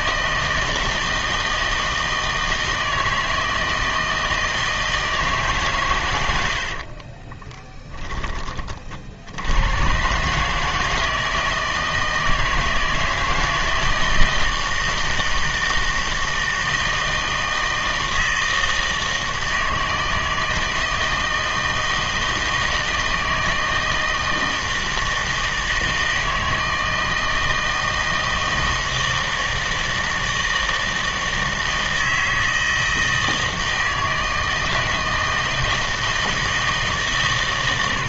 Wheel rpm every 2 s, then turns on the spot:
160, 160, 160, 40, 50, 160, 160, 160, 160, 160, 160, 160, 160, 160, 160, 160, 160, 160, 160.
6-8